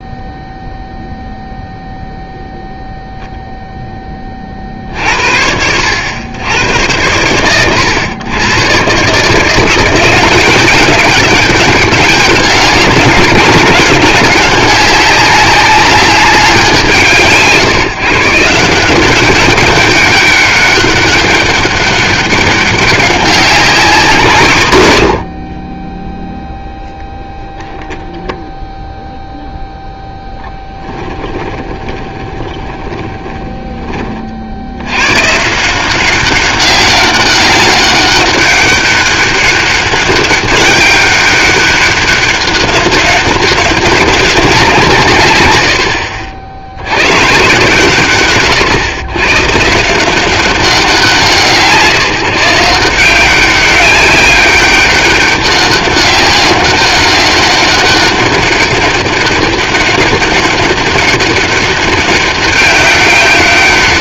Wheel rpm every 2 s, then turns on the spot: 0, 0, 50, 100, 120, 190, 190, 190, 160, 160, 200, 200, 140, 0, 0, 10, 20, 70, 190, 200, 200, 200, 180, 80, 130, 190, 170, 200, 190, 200, 200, 200.
30-34